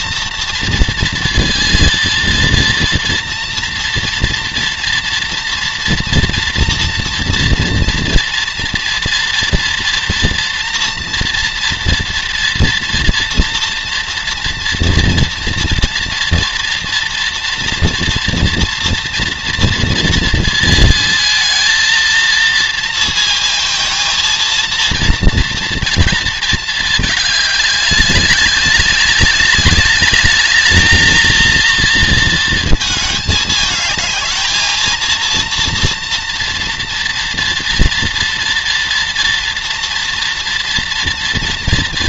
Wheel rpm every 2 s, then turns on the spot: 230, 230, 230, 240, 230, 230, 230, 240, 240, 230, 230, 230, 230, 220, 200, 220, 220, 220, 230, 230, 230.
none